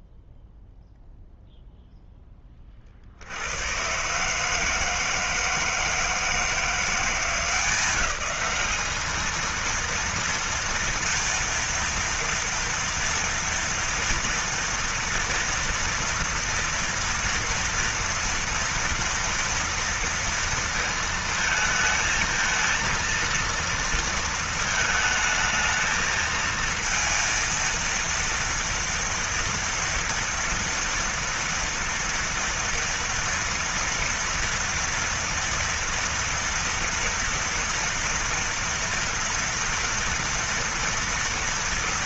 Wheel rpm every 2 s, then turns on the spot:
0, 10, 130, 160, 190, 230, 230, 230, 230, 230, 230, 230, 230, 220, 230, 230, 230, 230, 230, 240, 240.
none